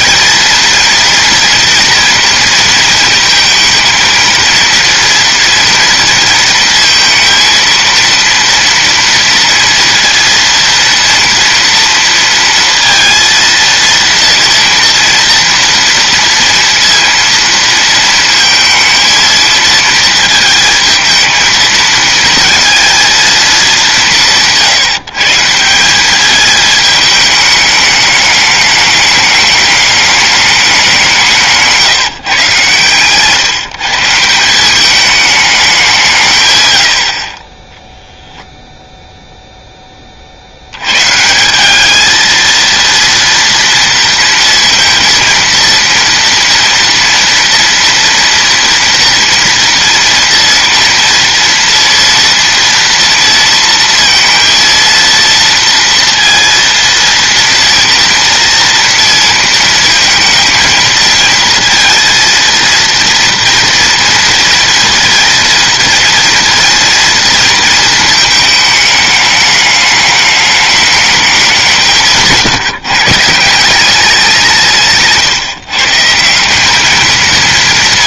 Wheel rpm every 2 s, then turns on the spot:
230, 230, 230, 230, 230, 230, 230, 230, 230, 230, 220, 230, 160, 210, 210, 200, 130, 190, 140, 0, 70, 230, 230, 230, 230, 230, 230, 230, 230, 240, 230, 230, 230, 230, 220, 210, 160, 160, 200.
none